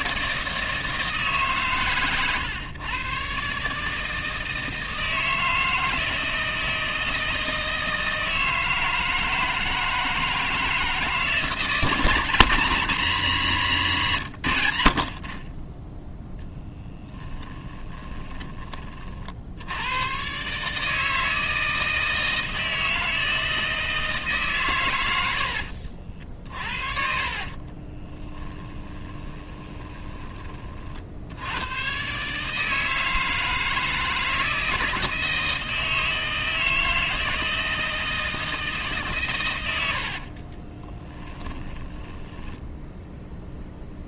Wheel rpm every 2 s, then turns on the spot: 160, 110, 160, 160, 160, 160, 190, 70, 10, 40, 160, 160, 120, 40, 20, 50, 160, 160, 160, 150, 20, 10.
16-18 26-30 40-42